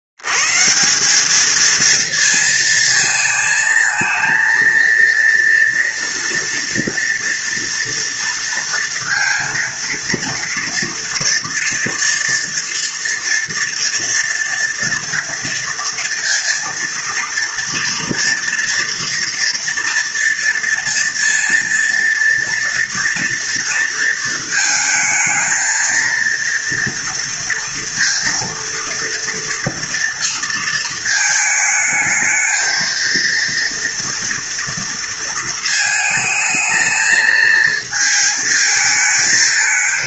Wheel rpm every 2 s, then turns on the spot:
70, 220, 230, 230, 230, 230, 230, 230, 230, 230, 230, 230, 230, 230, 230, 230, 220, 230, 220, 220.
none